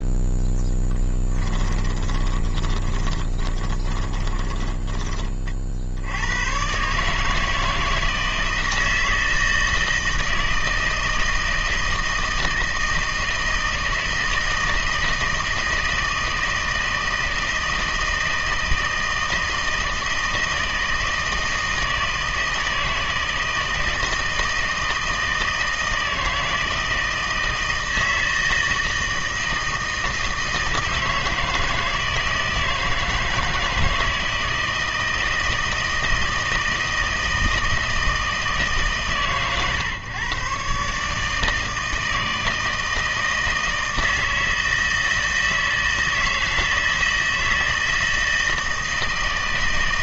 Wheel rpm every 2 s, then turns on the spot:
10, 20, 20, 130, 160, 160, 160, 160, 160, 160, 160, 160, 160, 160, 160, 160, 160, 160, 160, 150, 140, 160, 160, 160, 160.
0-4